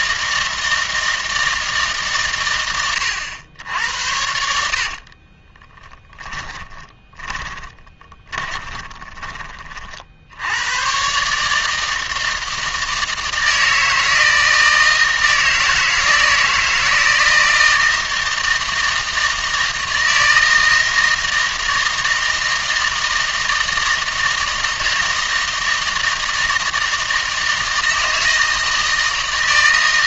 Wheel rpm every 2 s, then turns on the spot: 160, 110, 60, 20, 20, 110, 160, 160, 160, 160, 160, 160, 160, 160, 160.
4-10